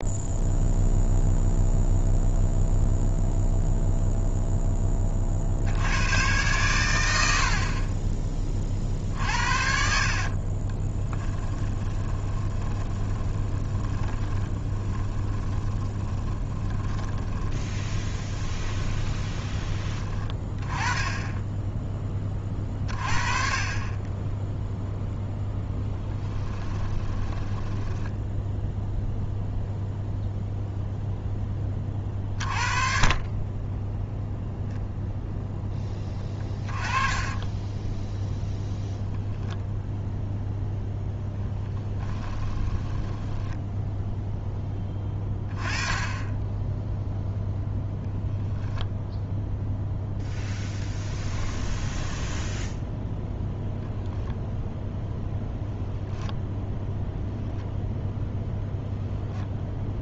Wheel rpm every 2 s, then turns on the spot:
0, 0, 20, 100, 40, 30, 20, 20, 20, 20, 20, 30, 0, 20, 0, 0, 30, 0, 30, 0, 0, 10, 10, 10, 0, 10, 10, 0, 0, 0.
8-20 26-28 36-38 42-44